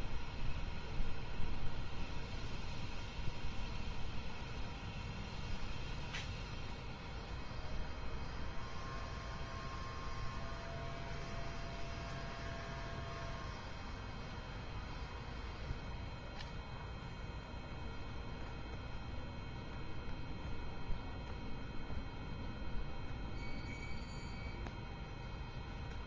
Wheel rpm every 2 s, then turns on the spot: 0, 0, 0, 0, 0, 0, 0, 0, 0, 0, 0, 0, 0.
none